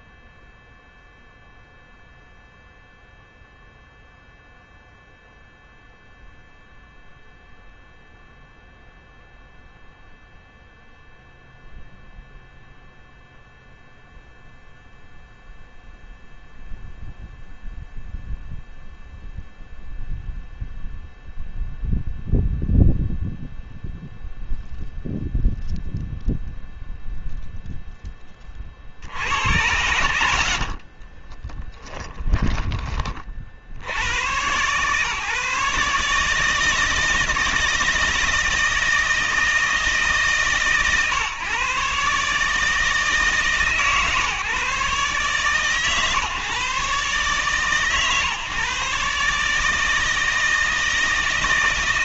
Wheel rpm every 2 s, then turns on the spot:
0, 0, 0, 0, 0, 0, 0, 0, 0, 0, 0, 0, 0, 0, 40, 50, 20, 120, 160, 160, 140, 150, 140, 150, 150, 160.
30-32